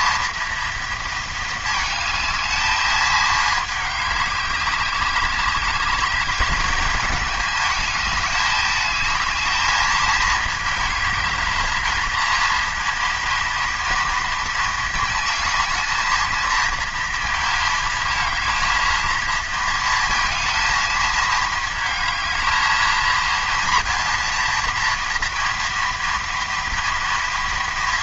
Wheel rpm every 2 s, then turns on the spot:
220, 220, 190, 220, 210, 220, 230, 220, 230, 220, 220, 230, 230, 230.
none